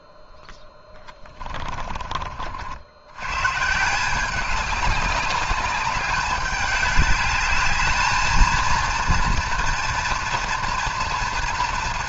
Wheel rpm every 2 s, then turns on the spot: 10, 80, 190, 200, 230, 230.
0-2